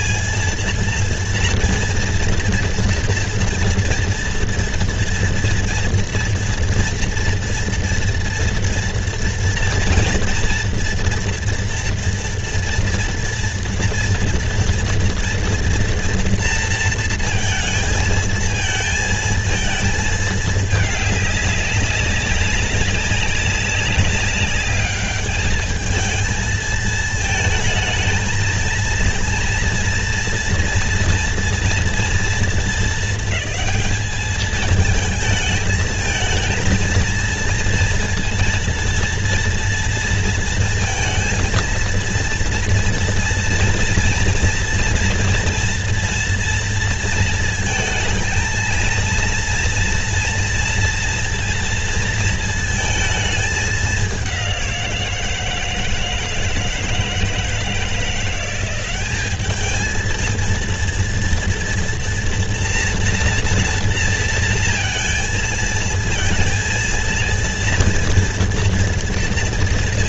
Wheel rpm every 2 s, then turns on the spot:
230, 240, 230, 230, 230, 230, 230, 230, 230, 230, 220, 200, 200, 220, 220, 230, 220, 220, 220, 230, 230, 230, 230, 230, 230, 230, 220, 180, 160, 190, 220, 230, 230, 230, 230.
none